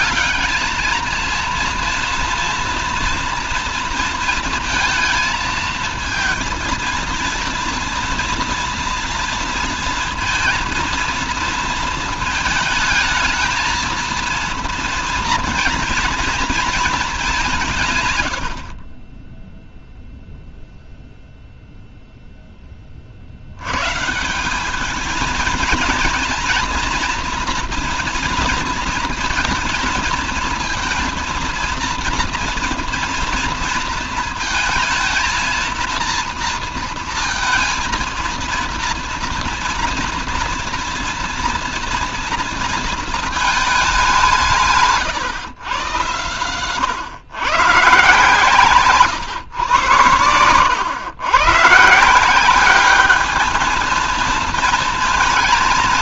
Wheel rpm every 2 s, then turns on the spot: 220, 230, 230, 230, 230, 230, 220, 230, 220, 50, 0, 20, 200, 230, 230, 230, 240, 220, 230, 230, 230, 230, 160, 120, 140, 100, 200, 230.
none